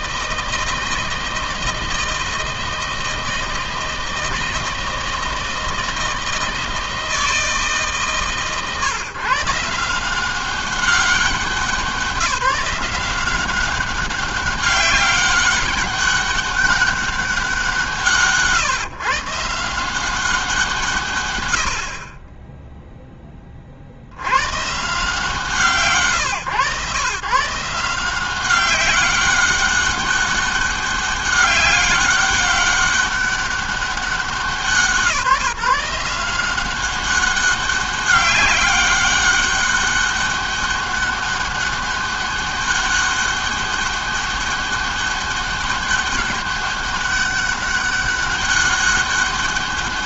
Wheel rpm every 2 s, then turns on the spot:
160, 160, 160, 160, 150, 190, 180, 200, 200, 150, 140, 10, 140, 130, 190, 200, 200, 170, 190, 200, 200, 200, 200, 200, 200.
none